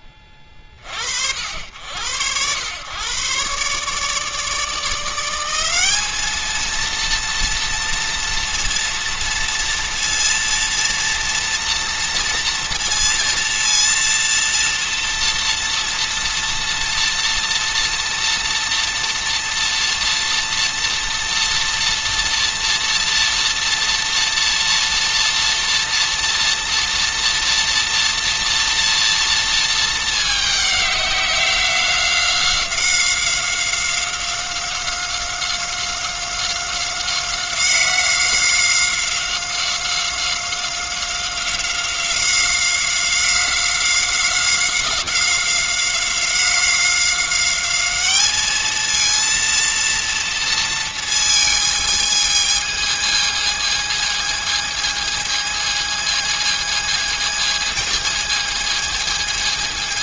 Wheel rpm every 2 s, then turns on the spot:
40, 110, 150, 220, 230, 230, 230, 230, 230, 230, 230, 230, 230, 230, 230, 210, 190, 180, 190, 180, 190, 180, 190, 190, 230, 230, 220, 220, 220, 220.
none